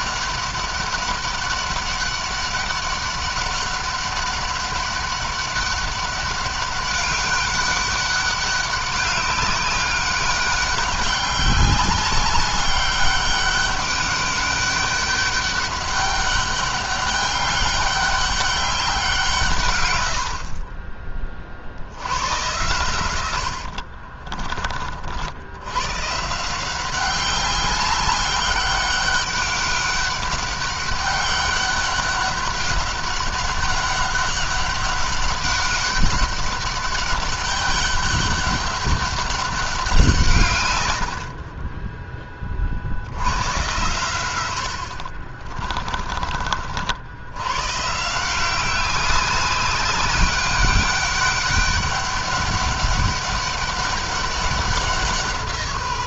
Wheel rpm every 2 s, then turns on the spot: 200, 200, 200, 200, 200, 190, 200, 200, 200, 190, 50, 100, 40, 180, 200, 200, 200, 200, 200, 200, 110, 40, 100, 60, 180, 190, 200, 190.
none